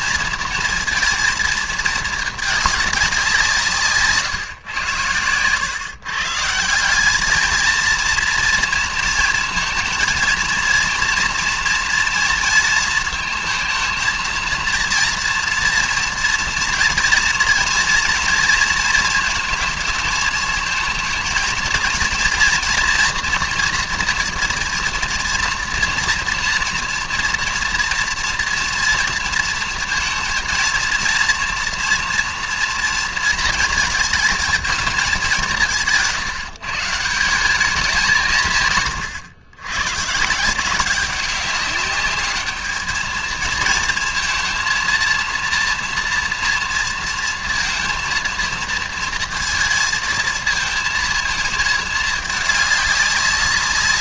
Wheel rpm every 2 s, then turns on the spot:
230, 210, 120, 160, 230, 230, 230, 230, 230, 230, 230, 240, 230, 230, 230, 230, 230, 220, 160, 160, 170, 210, 230, 230, 230, 230, 210.
none